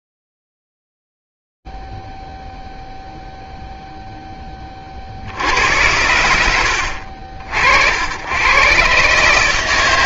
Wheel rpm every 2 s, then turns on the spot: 0, 0, 0, 100, 100.
none